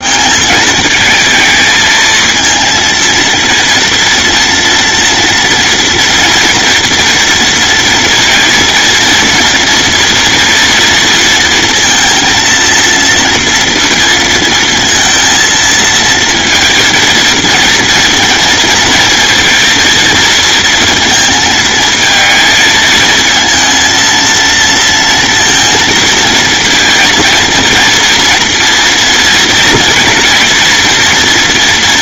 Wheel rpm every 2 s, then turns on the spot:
210, 230, 230, 240, 230, 230, 230, 230, 230, 230, 220, 220, 230, 230, 230, 230.
none